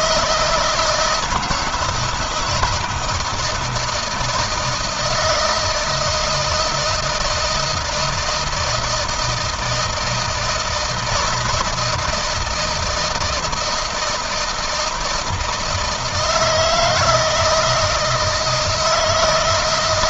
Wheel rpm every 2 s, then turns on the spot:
170, 170, 160, 160, 160, 160, 160, 160, 160, 160.
none